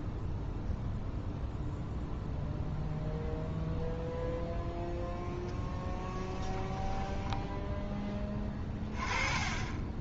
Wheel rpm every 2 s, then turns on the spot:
0, 0, 0, 10, 20.
6-8